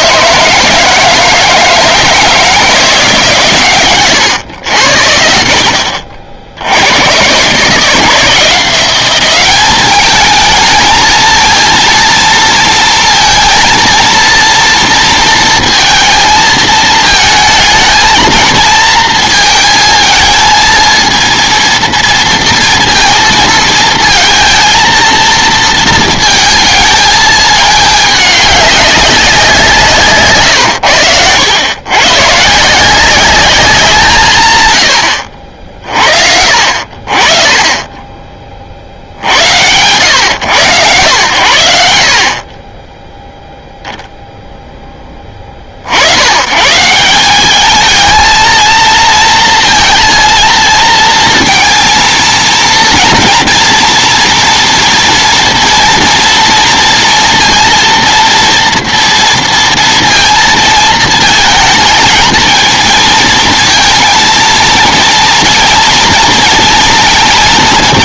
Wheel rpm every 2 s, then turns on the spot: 160, 170, 100, 90, 180, 220, 230, 230, 220, 220, 220, 230, 230, 220, 200, 120, 170, 120, 60, 60, 120, 20, 10, 150, 230, 230, 230, 230, 230, 230, 220, 230, 230, 230.
none